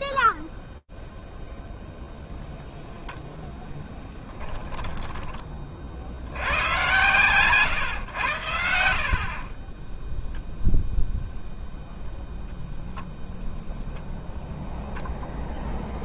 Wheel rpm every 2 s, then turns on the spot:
10, 20, 120, 40, 0, 0, 0, 100.
0-2 6-8